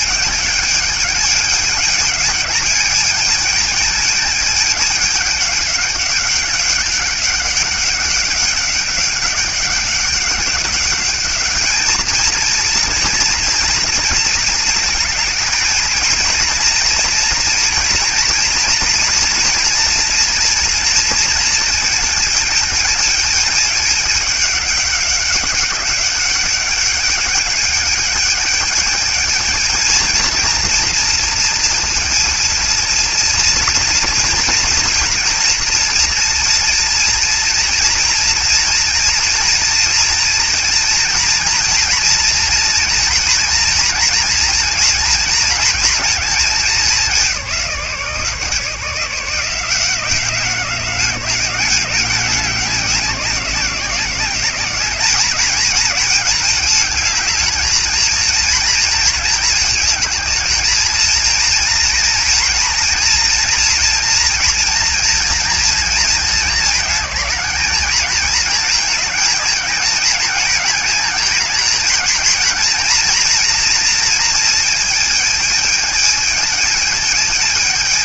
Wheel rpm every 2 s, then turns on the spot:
210, 210, 220, 200, 190, 200, 230, 230, 220, 230, 230, 220, 210, 200, 210, 230, 230, 230, 230, 230, 230, 230, 230, 200, 160, 190, 190, 190, 220, 230, 220, 230, 230, 220, 220, 220, 230, 220, 220.
none